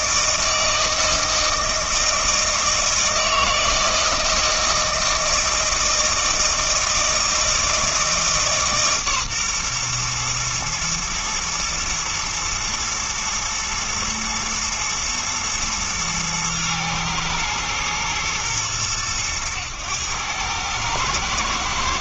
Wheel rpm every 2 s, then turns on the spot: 160, 160, 160, 160, 140, 120, 110, 110, 110, 110, 110.
none